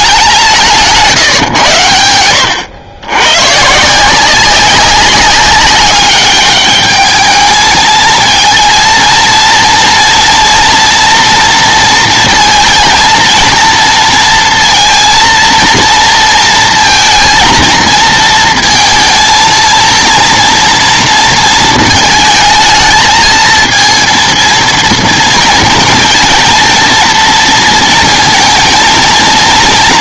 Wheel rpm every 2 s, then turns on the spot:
160, 100, 190, 210, 230, 230, 230, 230, 230, 230, 230, 220, 230, 230, 230.
none